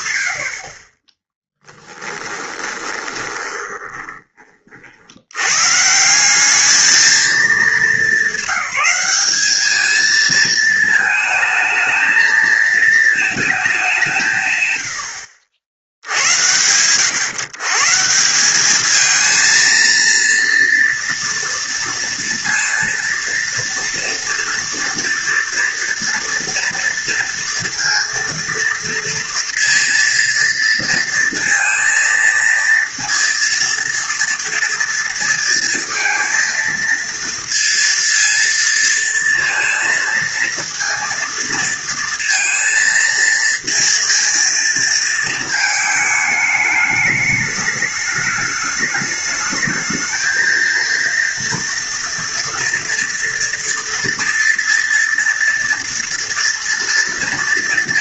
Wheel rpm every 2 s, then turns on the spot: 50, 20, 80, 220, 200, 220, 220, 80, 130, 220, 240, 230, 230, 230, 230, 230, 230, 230, 230, 230, 230, 230, 230, 210, 210, 230, 230, 230, 230.
2-4